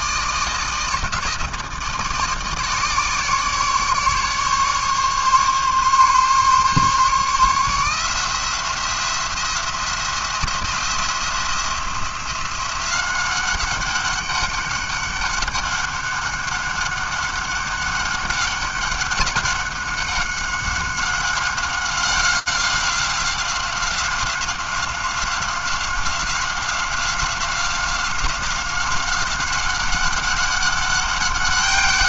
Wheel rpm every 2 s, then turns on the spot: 160, 150, 140, 140, 170, 170, 180, 200, 200, 200, 190, 190, 190, 190, 190, 190.
none